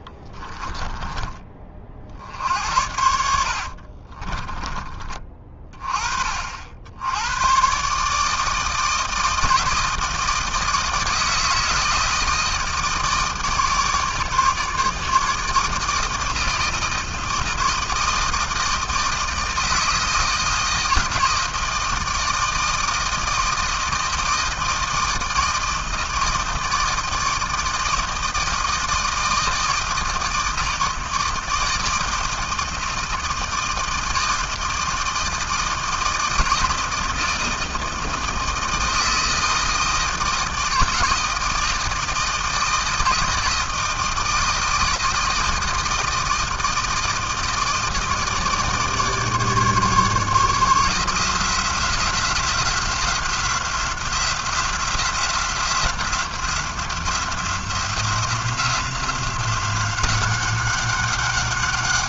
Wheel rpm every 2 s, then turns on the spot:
20, 70, 20, 60, 160, 160, 160, 150, 160, 160, 160, 160, 160, 160, 160, 160, 160, 160, 160, 160, 160, 160, 160, 160, 150, 160, 170, 180, 180, 170, 190.
0-2 4-6